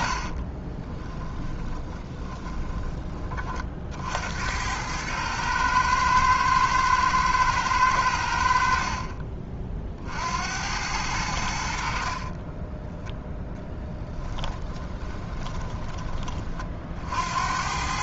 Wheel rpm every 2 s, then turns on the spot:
20, 20, 100, 110, 50, 90, 10, 20, 50.
0-2 8-10 12-16